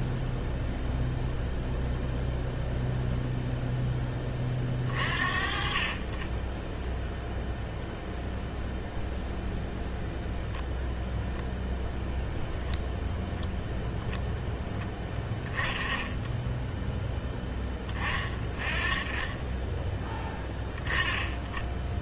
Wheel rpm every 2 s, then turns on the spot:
0, 0, 40, 0, 0, 0, 10, 10, 10, 20, 10.
12-14